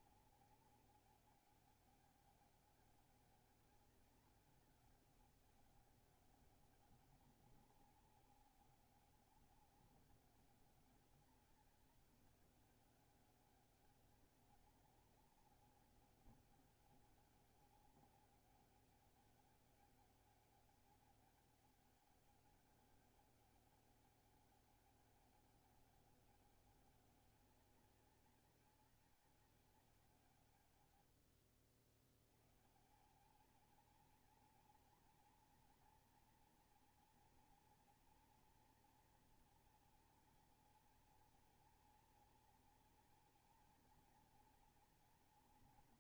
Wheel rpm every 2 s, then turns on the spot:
200, 200, 200, 200, 190, 190, 200, 200, 200, 200, 200, 200, 200, 200, 190, 140, 110, 230, 230, 240, 230, 230, 230.
none